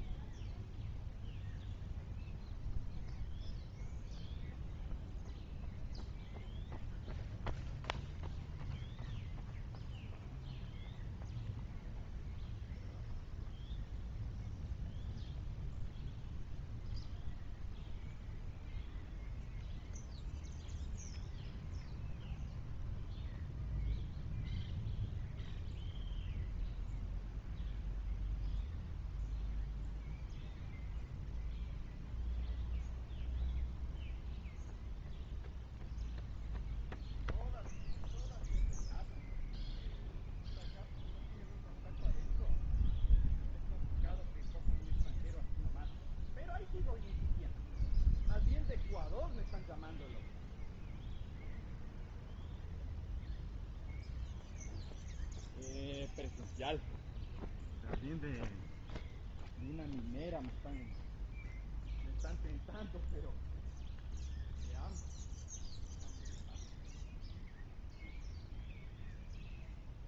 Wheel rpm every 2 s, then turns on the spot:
0, 0, 0, 0, 0, 0, 0, 0, 0, 0, 0, 0, 0, 0, 0, 0, 0, 0, 0, 0, 0, 0, 0, 0, 0, 0, 0, 0, 0, 0, 0, 0, 0, 0, 0.
none